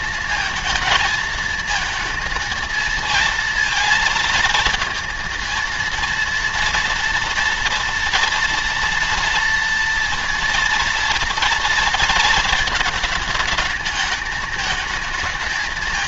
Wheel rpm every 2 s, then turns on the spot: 230, 230, 230, 230, 230, 230, 220, 220.
none